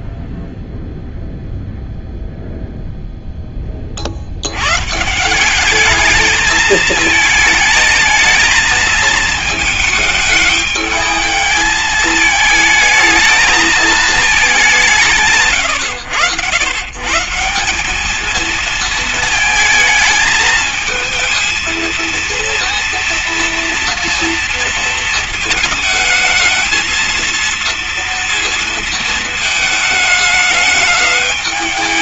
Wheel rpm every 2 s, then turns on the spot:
0, 0, 110, 220, 220, 210, 220, 200, 110, 230, 220, 230, 230, 220, 230, 220.
none